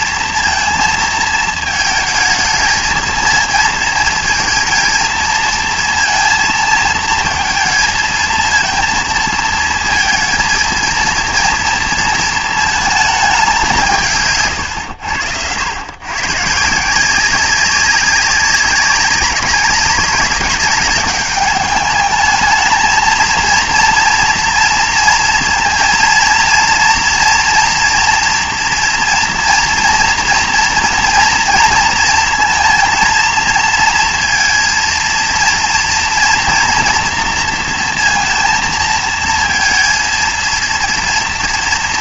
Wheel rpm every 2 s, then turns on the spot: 230, 220, 220, 230, 230, 230, 220, 120, 160, 190, 200, 220, 230, 230, 230, 230, 230, 230, 230, 220, 230.
none